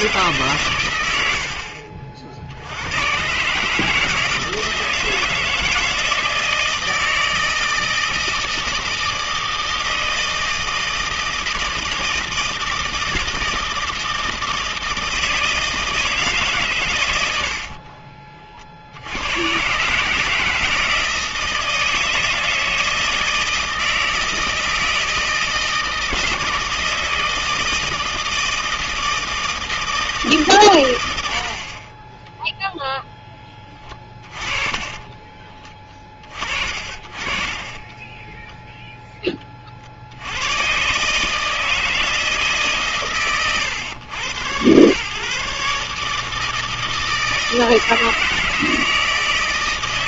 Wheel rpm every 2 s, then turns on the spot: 130, 70, 160, 160, 160, 160, 160, 160, 140, 40, 160, 160, 160, 170, 160, 130, 0, 30, 40, 0, 120, 150, 110, 160, 160.
34-38